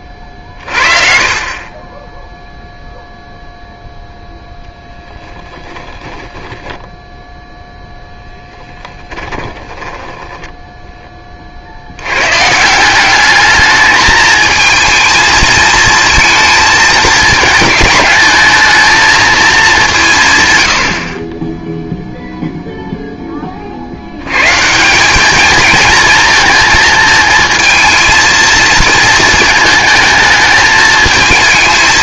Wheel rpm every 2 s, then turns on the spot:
30, 0, 10, 10, 20, 10, 160, 220, 220, 220, 100, 0, 160, 230, 230, 220.
6-12